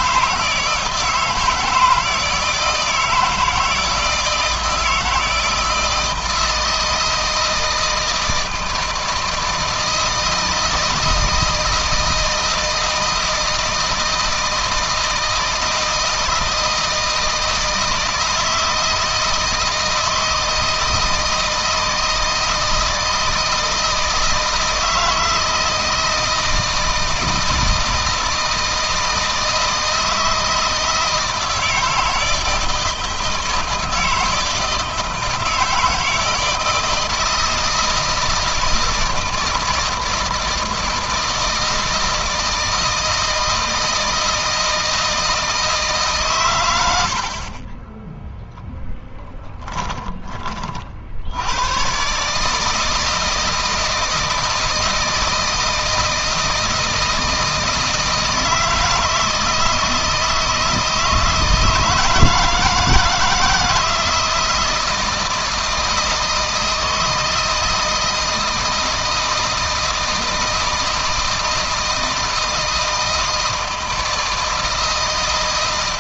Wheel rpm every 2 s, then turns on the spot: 160, 160, 160, 160, 160, 160, 160, 160, 160, 160, 160, 160, 160, 160, 160, 160, 160, 160, 160, 160, 160, 160, 160, 100, 0, 50, 150, 160, 160, 160, 160, 160, 170, 160, 160, 160, 160, 160.
none